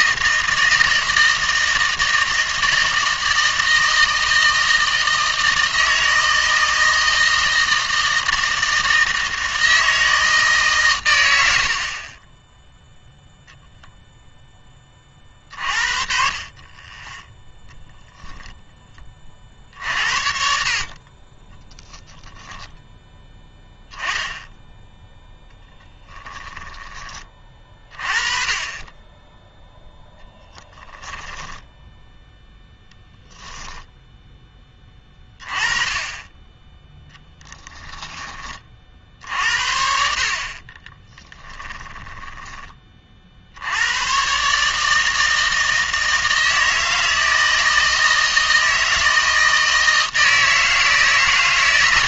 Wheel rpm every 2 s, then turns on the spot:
160, 160, 160, 160, 160, 150, 10, 20, 30, 10, 50, 10, 10, 10, 30, 10, 0, 20, 10, 50, 30, 20, 150, 160, 160, 160.
26-28 30-32 40-42